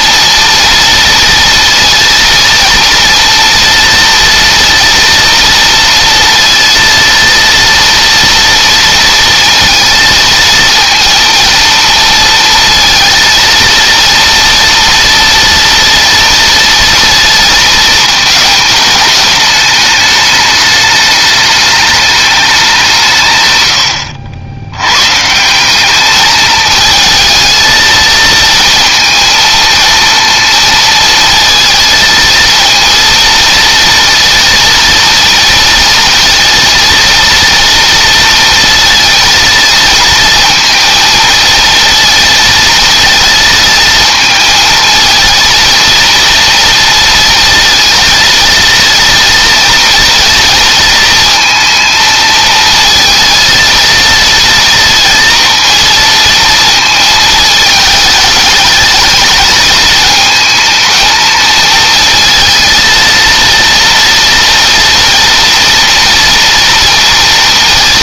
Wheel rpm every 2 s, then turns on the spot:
230, 230, 230, 230, 230, 230, 230, 230, 220, 210, 210, 170, 130, 220, 230, 230, 230, 230, 230, 230, 230, 230, 230, 230, 230, 230, 230, 230, 220, 220, 220, 230, 230, 230.
none